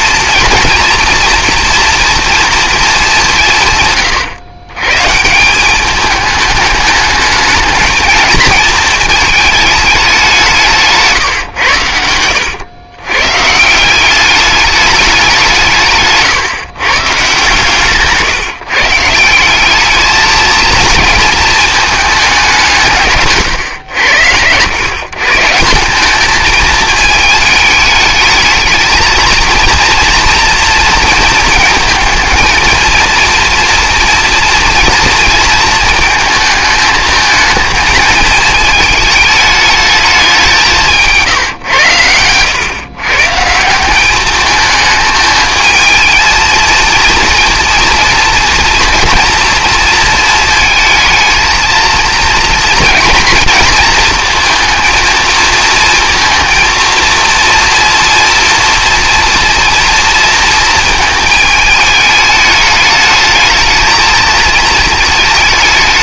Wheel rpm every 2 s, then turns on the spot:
230, 220, 130, 210, 220, 160, 110, 200, 130, 150, 230, 170, 120, 220, 220, 230, 230, 230, 220, 220, 180, 110, 220, 230, 230, 220, 230, 220, 230, 230, 220, 210, 220.
none